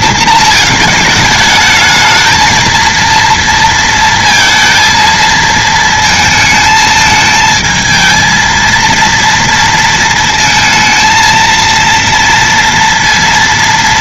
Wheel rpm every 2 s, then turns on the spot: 220, 230, 230, 220, 230, 220, 230.
none